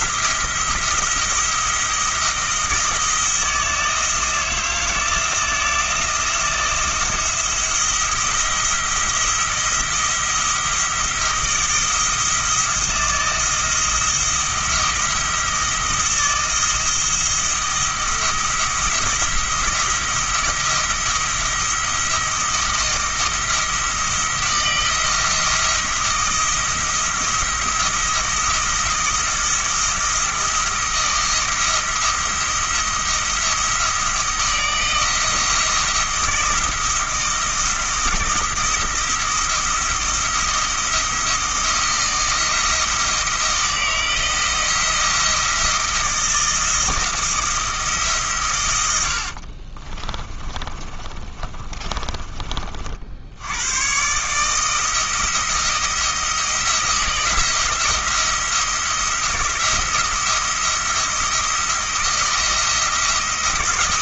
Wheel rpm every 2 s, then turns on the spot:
170, 160, 160, 170, 170, 170, 170, 170, 170, 170, 170, 160, 160, 170, 170, 170, 170, 170, 170, 170, 170, 170, 170, 170, 100, 30, 60, 160, 160, 170, 170, 170.
48-52